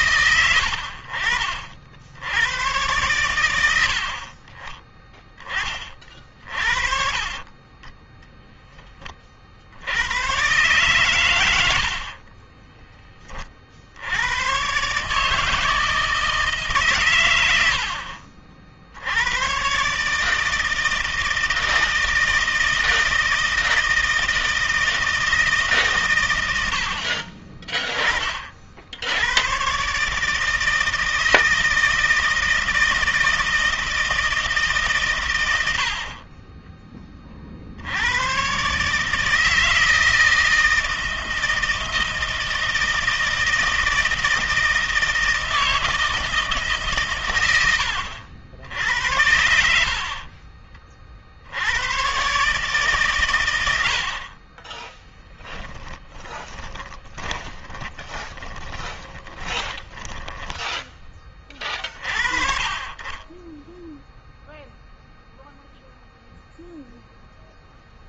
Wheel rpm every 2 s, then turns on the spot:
90, 100, 20, 50, 20, 120, 20, 120, 140, 60, 160, 160, 160, 80, 60, 160, 160, 150, 30, 140, 160, 160, 160, 150, 70, 40, 140, 20, 30, 20, 10, 30, 0, 0.
12-14 56-60